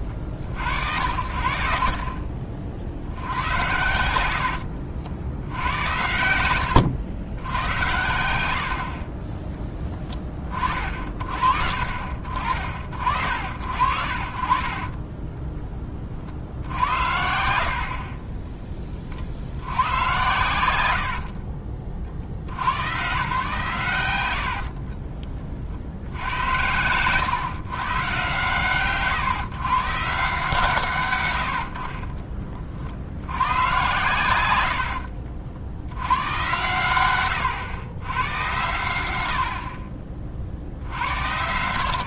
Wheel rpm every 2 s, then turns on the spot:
60, 60, 70, 90, 60, 40, 50, 40, 70, 20, 80, 110, 50, 100, 130, 140, 40, 70, 110, 100, 70.
4-6 24-26